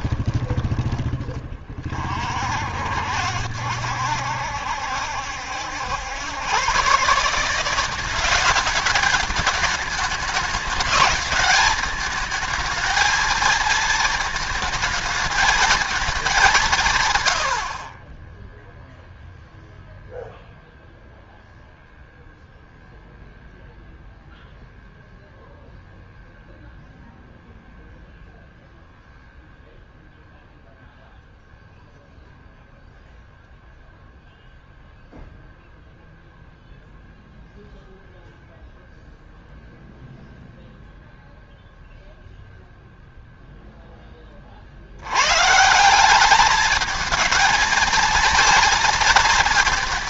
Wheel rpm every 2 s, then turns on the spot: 20, 50, 70, 130, 200, 210, 220, 220, 170, 10, 0, 0, 0, 0, 0, 0, 0, 0, 0, 0, 0, 0, 50, 210, 230.
none